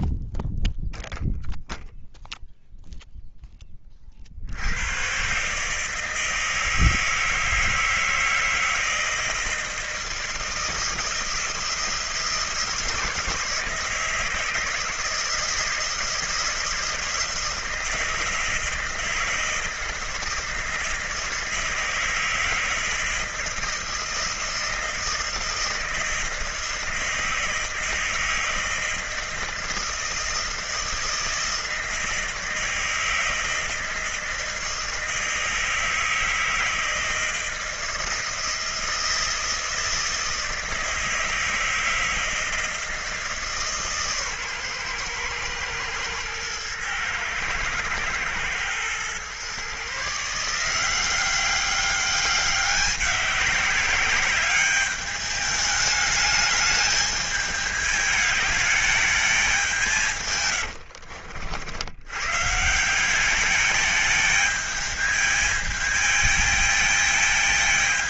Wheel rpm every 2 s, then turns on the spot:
0, 0, 80, 160, 160, 160, 160, 160, 160, 160, 160, 170, 160, 160, 160, 160, 160, 160, 160, 160, 160, 160, 120, 120, 120, 170, 190, 200, 210, 210, 80, 170, 220, 220.
60-62